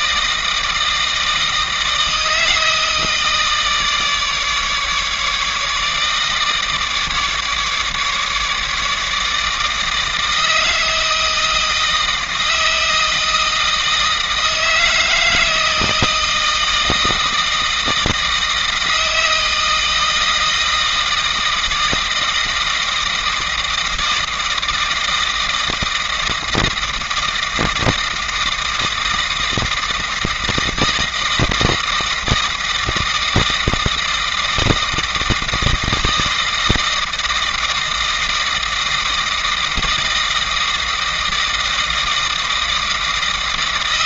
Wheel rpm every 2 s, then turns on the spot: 160, 160, 150, 150, 150, 160, 160, 160, 160, 160, 160, 160, 160, 160, 160, 160, 160, 160, 160, 160, 160, 160.
none